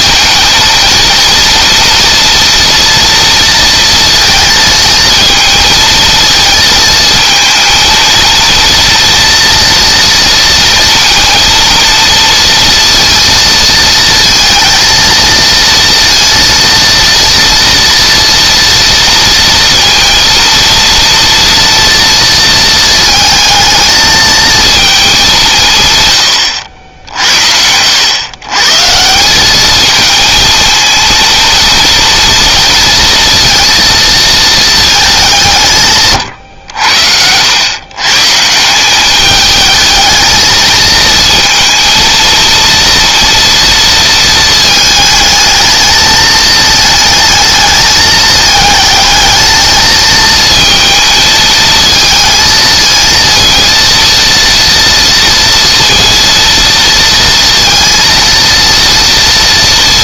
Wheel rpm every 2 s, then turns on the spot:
230, 230, 230, 220, 230, 230, 230, 230, 230, 230, 230, 220, 210, 70, 160, 230, 230, 210, 90, 200, 220, 230, 220, 220, 220, 220, 230, 230, 230, 230.
36-38